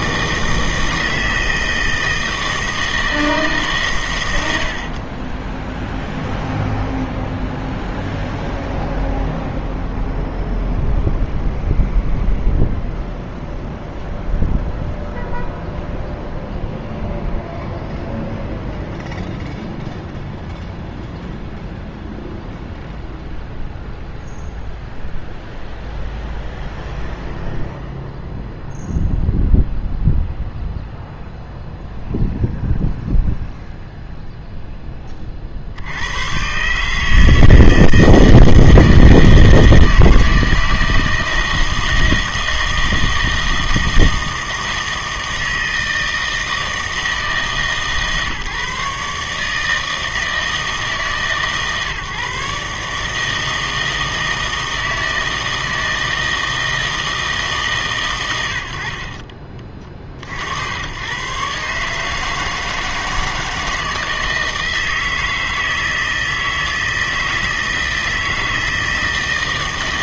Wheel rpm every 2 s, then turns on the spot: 160, 160, 80, 0, 0, 0, 0, 0, 0, 0, 0, 0, 0, 0, 0, 0, 0, 0, 130, 160, 160, 160, 160, 160, 150, 160, 140, 160, 160, 90, 80, 160, 160, 160, 160.
none